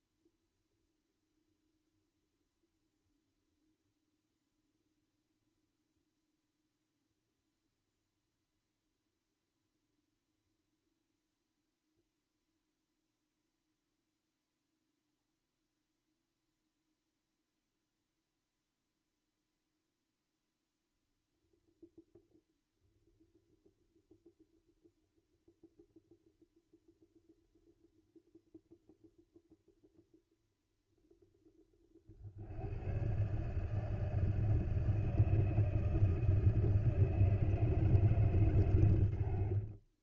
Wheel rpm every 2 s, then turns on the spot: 0, 0, 0, 0, 0, 0, 0, 0, 0, 0, 0, 0, 0, 0, 0, 0, 100, 160, 160, 110.
none